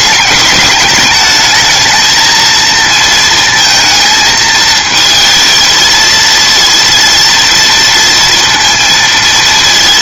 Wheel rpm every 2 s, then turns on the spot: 210, 210, 230, 220, 230.
none